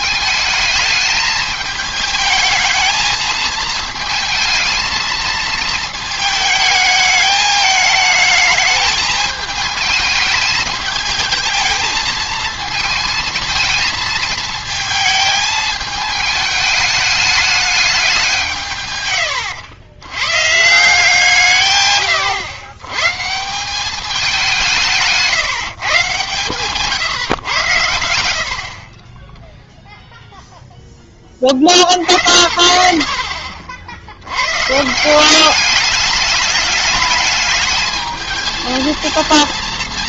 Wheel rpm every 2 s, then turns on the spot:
220, 220, 220, 220, 220, 220, 220, 220, 210, 150, 150, 110, 170, 130, 50, 0, 50, 130, 210, 220.
none